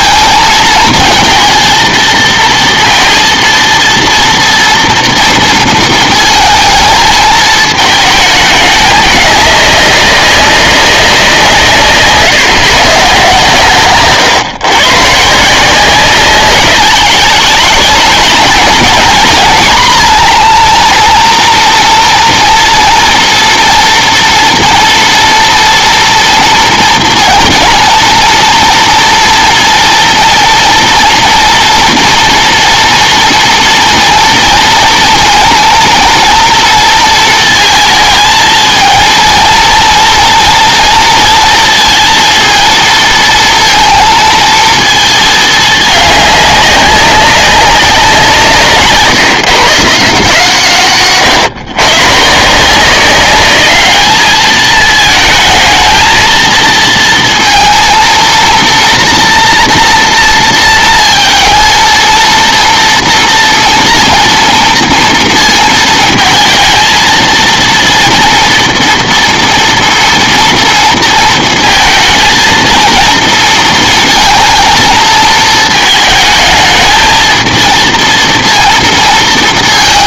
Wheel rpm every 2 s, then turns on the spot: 230, 230, 230, 220, 210, 200, 130, 130, 190, 210, 230, 230, 230, 230, 230, 230, 230, 230, 230, 220, 230, 230, 220, 200, 150, 140, 170, 220, 230, 230, 230, 230, 230, 230, 230, 230, 230, 230, 220, 230.
none